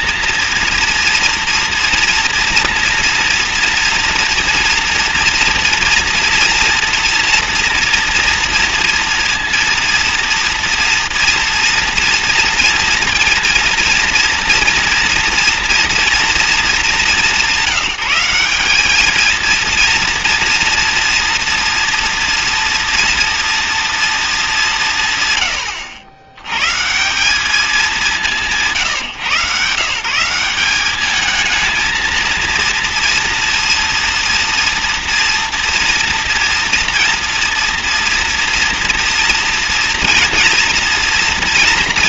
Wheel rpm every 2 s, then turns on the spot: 230, 230, 230, 230, 230, 230, 230, 230, 220, 200, 230, 230, 200, 120, 160, 190, 230, 230, 230, 230, 230.
none